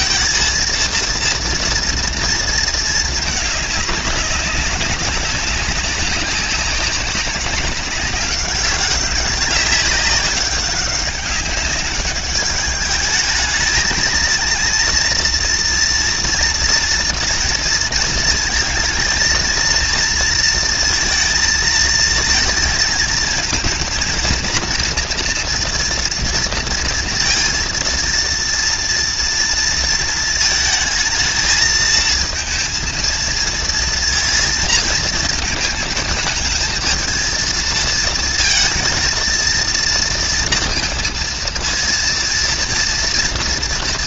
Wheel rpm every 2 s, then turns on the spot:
230, 230, 210, 190, 200, 200, 200, 220, 230, 220, 230, 230, 230, 230, 230, 230, 220, 230, 220, 220, 230, 230.
none